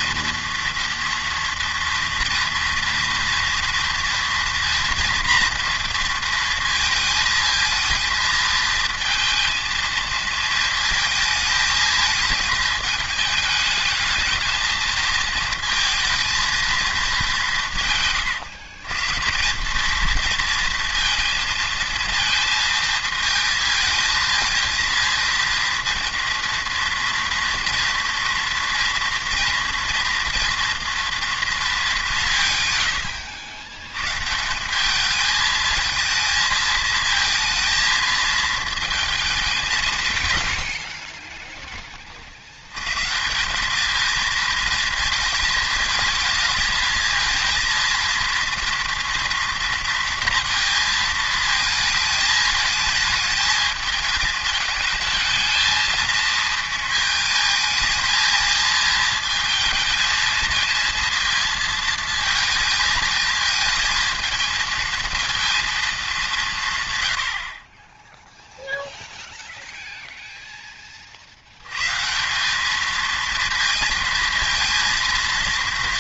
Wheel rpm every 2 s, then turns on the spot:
230, 230, 240, 230, 220, 220, 210, 220, 230, 130, 230, 220, 230, 230, 240, 230, 110, 190, 220, 220, 60, 100, 230, 220, 230, 220, 220, 220, 230, 220, 230, 220, 220, 140, 0, 20, 210, 230.
40-42